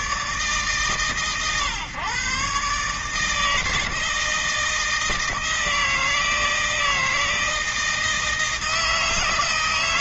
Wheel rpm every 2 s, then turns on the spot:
140, 150, 160, 160, 160.
none